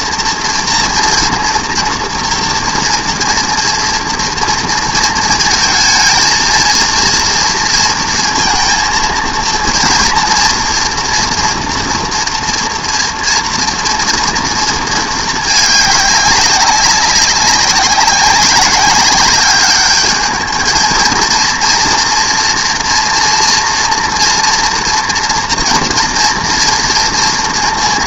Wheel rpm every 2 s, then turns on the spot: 230, 240, 230, 230, 230, 230, 230, 230, 190, 200, 220, 230, 240, 240.
none